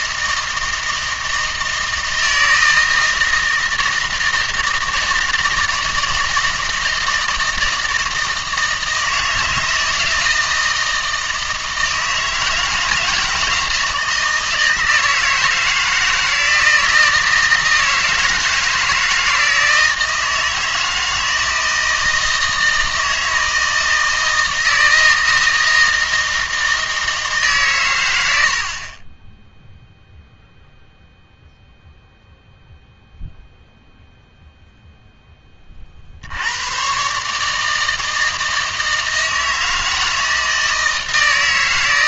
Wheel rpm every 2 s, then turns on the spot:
160, 160, 160, 160, 160, 160, 160, 160, 170, 160, 160, 160, 160, 160, 50, 0, 0, 0, 120, 160, 160.
none